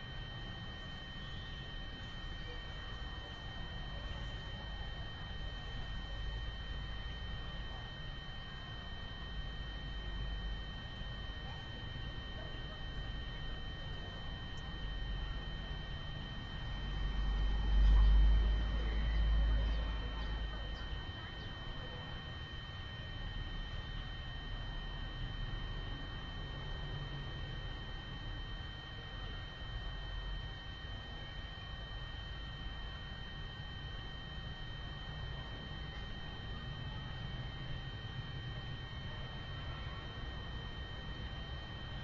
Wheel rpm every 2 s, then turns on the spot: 0, 0, 0, 0, 0, 0, 0, 0, 0, 0, 0, 0, 0, 0, 0, 0, 0, 0, 0, 0, 0.
none